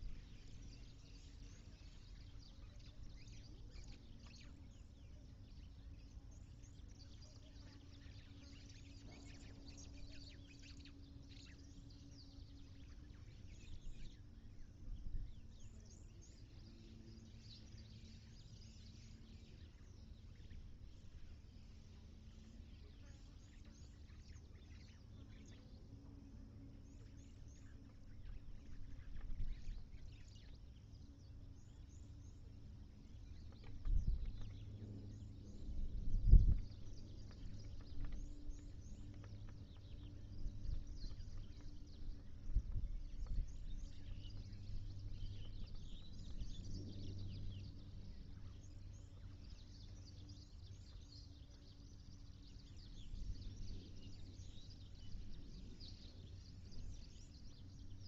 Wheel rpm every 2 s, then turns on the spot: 0, 0, 0, 0, 0, 0, 0, 0, 0, 0, 0, 0, 0, 0, 0, 0, 0, 0, 0, 0, 0, 0, 0, 0, 0, 0, 0, 0, 0.
none